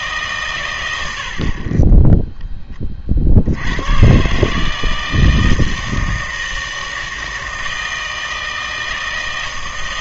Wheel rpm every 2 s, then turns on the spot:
120, 20, 150, 160, 160.
none